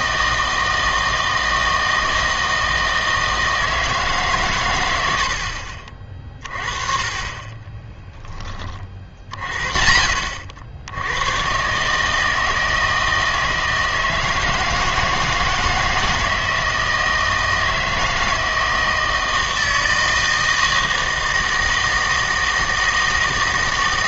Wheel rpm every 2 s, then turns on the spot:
160, 160, 120, 30, 30, 70, 160, 160, 160, 160, 160, 160.
none